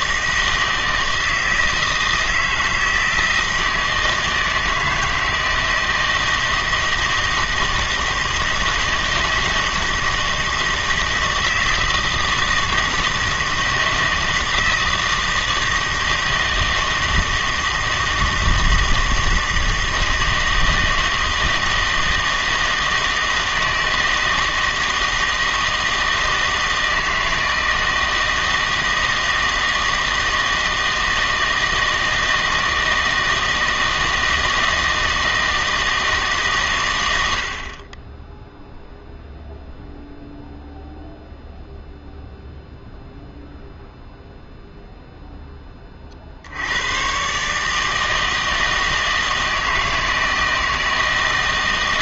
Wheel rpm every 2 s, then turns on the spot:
160, 160, 160, 160, 160, 160, 160, 160, 160, 160, 160, 160, 160, 160, 160, 160, 160, 160, 130, 0, 0, 0, 0, 80, 160, 160.
none